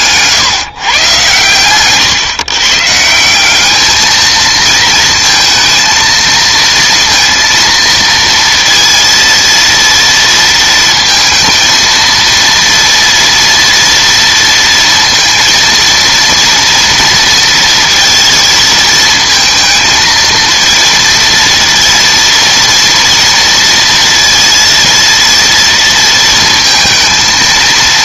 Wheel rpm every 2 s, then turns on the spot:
130, 140, 230, 230, 230, 230, 230, 230, 230, 220, 220, 230, 230, 230.
none